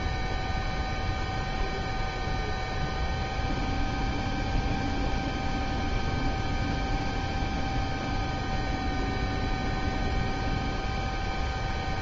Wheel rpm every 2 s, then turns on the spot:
0, 0, 0, 0, 0, 0.
none